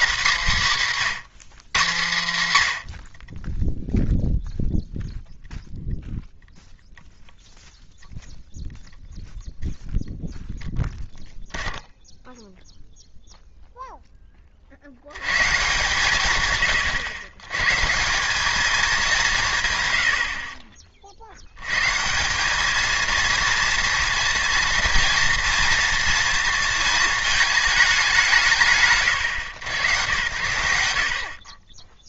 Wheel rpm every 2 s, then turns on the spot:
210, 120, 0, 0, 0, 0, 0, 40, 130, 200, 50, 210, 230, 220, 90, 80.
none